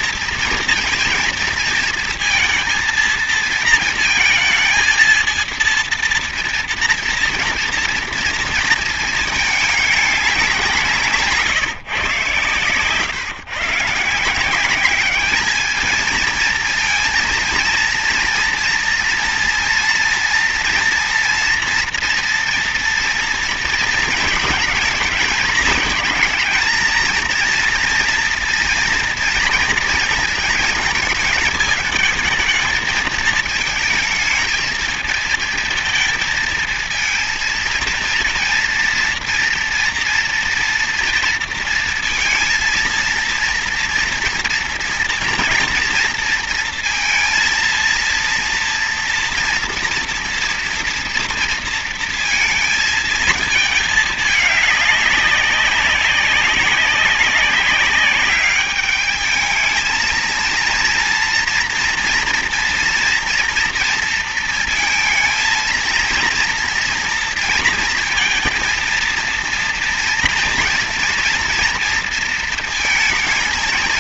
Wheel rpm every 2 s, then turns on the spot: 230, 230, 220, 230, 230, 190, 130, 170, 230, 230, 230, 230, 220, 220, 230, 220, 220, 220, 230, 230, 230, 230, 230, 230, 230, 230, 230, 210, 200, 200, 230, 240, 230, 230, 230, 230, 230.
none